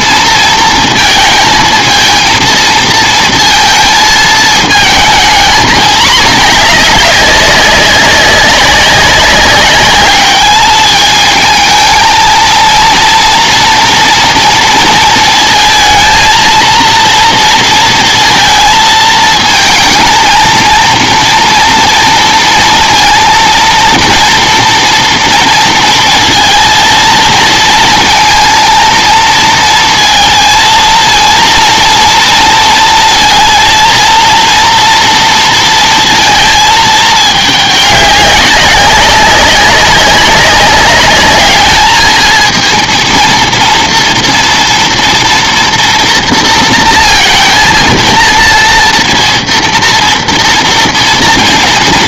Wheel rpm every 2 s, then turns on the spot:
230, 230, 220, 210, 190, 210, 230, 230, 230, 220, 230, 230, 240, 230, 230, 230, 230, 230, 220, 200, 200, 220, 230, 230, 230, 230.
none